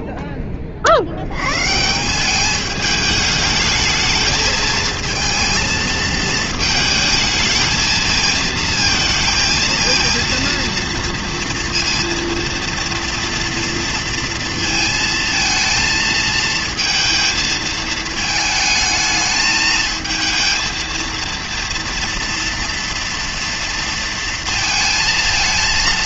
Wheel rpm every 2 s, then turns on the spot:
30, 200, 220, 220, 230, 230, 230, 230, 230, 220, 230, 230, 230.
none